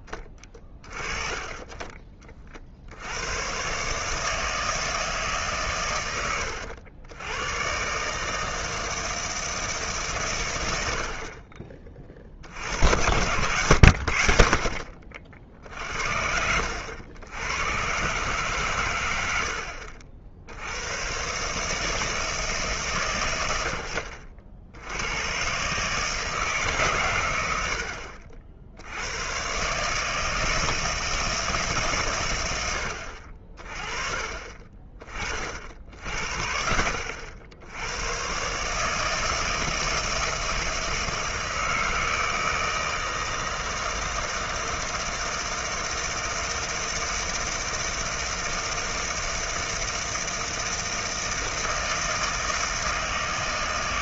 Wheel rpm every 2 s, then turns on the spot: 20, 50, 160, 90, 160, 90, 70, 50, 80, 130, 80, 150, 80, 150, 70, 160, 90, 30, 60, 140, 160, 160, 160, 160, 160, 160, 160.
none